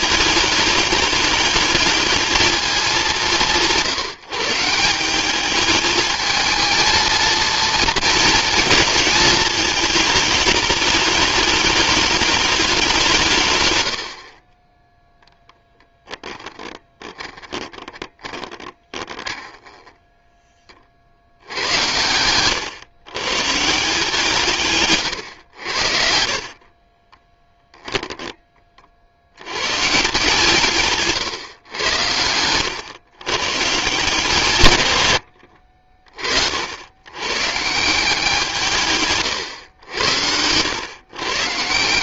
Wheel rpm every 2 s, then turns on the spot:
210, 200, 170, 220, 220, 210, 180, 10, 20, 20, 50, 120, 130, 30, 50, 140, 120, 120, 100, 150, 120.
16-20 26-28 30-32